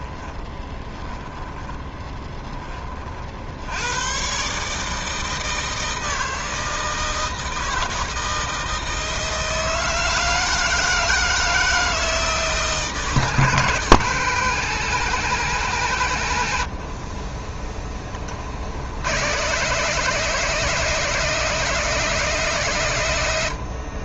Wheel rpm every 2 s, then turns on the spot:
10, 20, 150, 160, 160, 160, 160, 170, 110, 50, 180, 150.
0-2